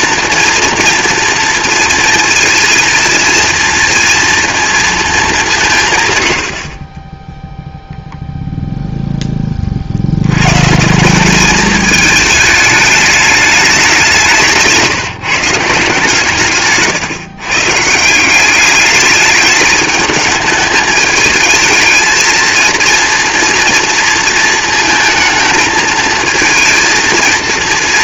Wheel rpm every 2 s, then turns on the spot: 240, 230, 230, 50, 0, 130, 210, 160, 130, 200, 220, 230, 230, 220.
14-18